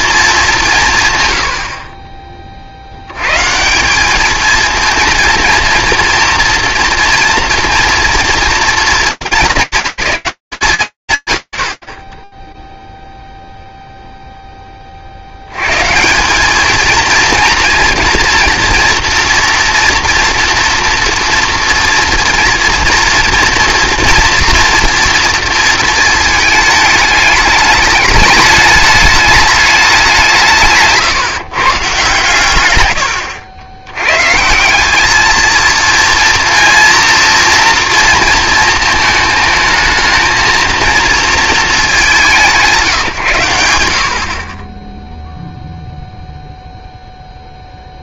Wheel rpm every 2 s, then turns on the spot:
150, 70, 220, 240, 220, 190, 0, 30, 230, 240, 240, 230, 230, 220, 210, 150, 110, 200, 230, 220, 230, 150, 0, 0.
none